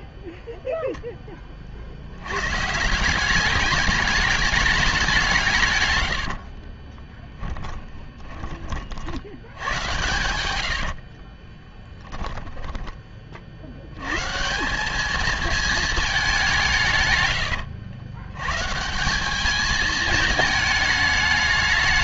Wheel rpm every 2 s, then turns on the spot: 0, 130, 210, 50, 30, 90, 20, 160, 180, 140, 220.
6-8 10-14